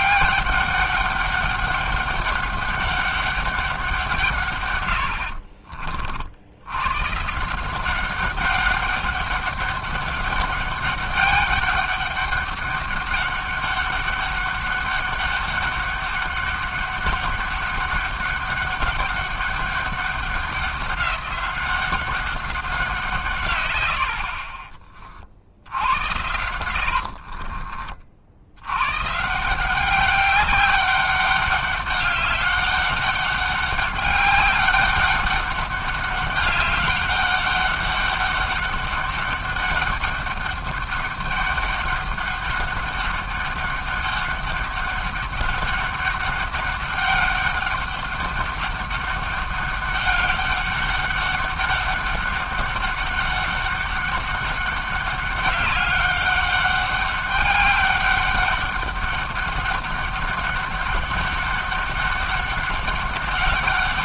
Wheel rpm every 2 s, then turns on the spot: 200, 200, 130, 90, 190, 200, 200, 200, 200, 200, 190, 190, 30, 90, 80, 190, 200, 200, 200, 200, 200, 200, 200, 200, 200, 200, 200, 200, 200, 200, 200, 200.
26-28